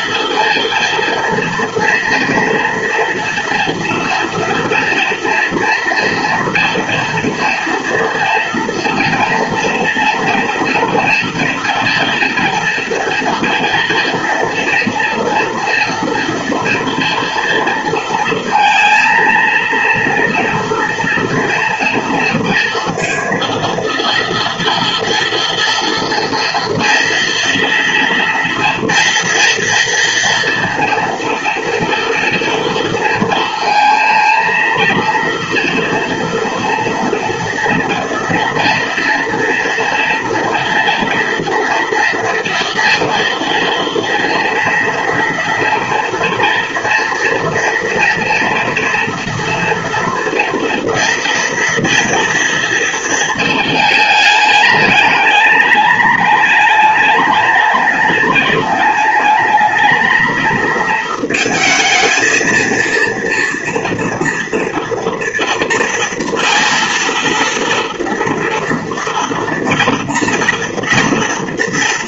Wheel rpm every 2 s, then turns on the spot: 230, 240, 230, 230, 230, 230, 230, 230, 230, 230, 230, 230, 230, 230, 230, 230, 230, 230, 230, 230, 240, 230, 230, 230, 230, 230, 230, 210, 210, 210, 230, 230, 230, 230, 240, 230.
none